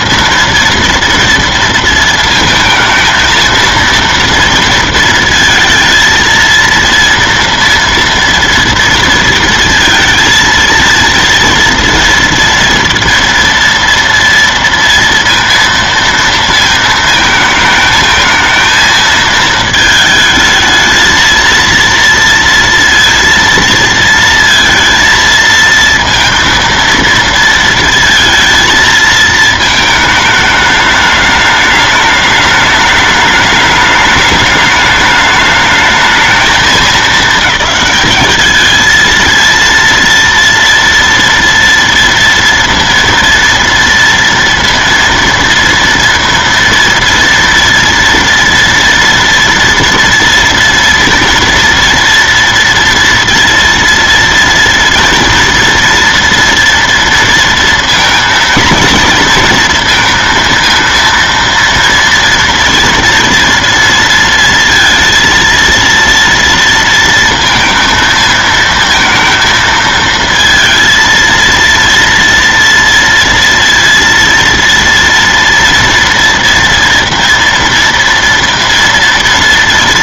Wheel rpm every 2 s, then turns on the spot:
230, 220, 230, 230, 230, 230, 230, 230, 230, 220, 220, 230, 230, 230, 230, 210, 210, 210, 220, 220, 230, 230, 230, 230, 240, 230, 230, 230, 230, 230, 230, 230, 230, 230, 230, 230, 230, 230, 230, 230.
none